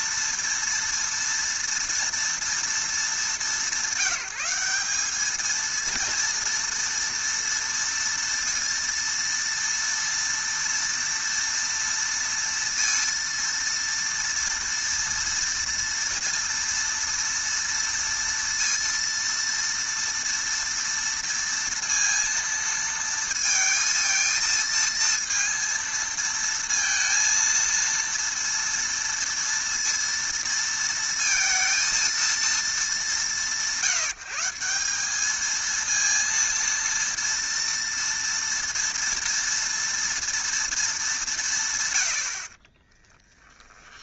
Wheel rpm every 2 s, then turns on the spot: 230, 230, 190, 230, 230, 230, 230, 230, 230, 230, 230, 230, 230, 230, 230, 230, 220, 170, 230, 230, 230, 40.
42-44